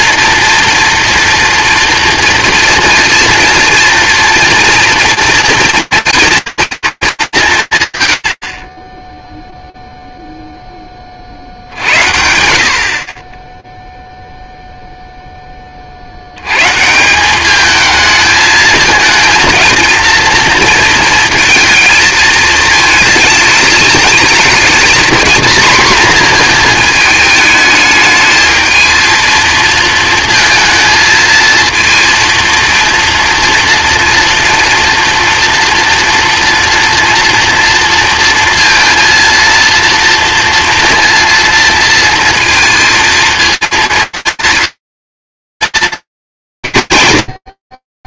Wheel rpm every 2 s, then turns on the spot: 230, 230, 230, 220, 20, 20, 60, 0, 190, 220, 230, 220, 240, 220, 220, 220, 240, 230, 230, 230, 230, 230, 230, 100.
none